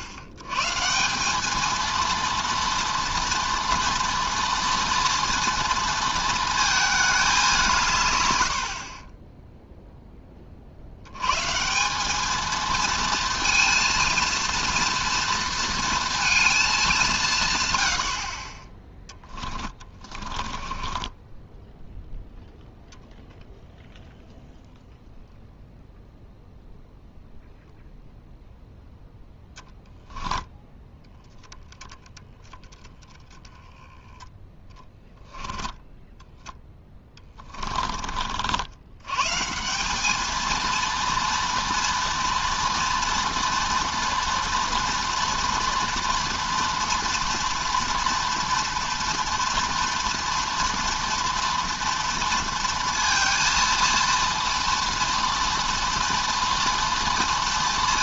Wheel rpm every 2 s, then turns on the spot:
100, 230, 230, 220, 70, 40, 220, 230, 230, 30, 20, 0, 0, 0, 0, 20, 20, 10, 10, 70, 230, 230, 230, 230, 230, 230, 230, 230, 230.
34-38